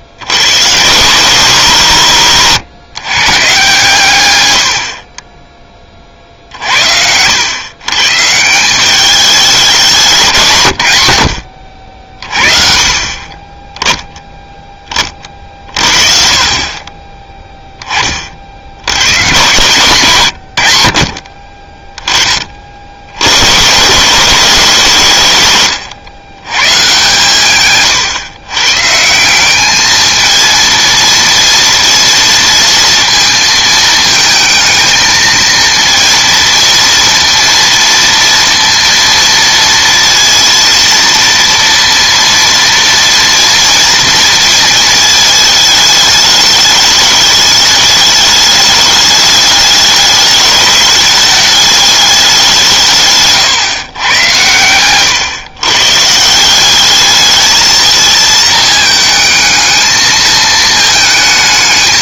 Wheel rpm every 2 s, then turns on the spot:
120, 130, 90, 60, 180, 110, 40, 10, 40, 80, 70, 50, 160, 130, 130, 230, 230, 220, 230, 230, 230, 230, 220, 210, 210, 210, 160, 110, 190, 220, 220.
none